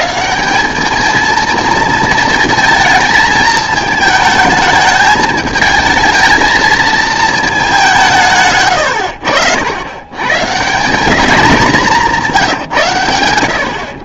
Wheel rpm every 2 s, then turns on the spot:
190, 220, 220, 220, 120, 180, 150.
none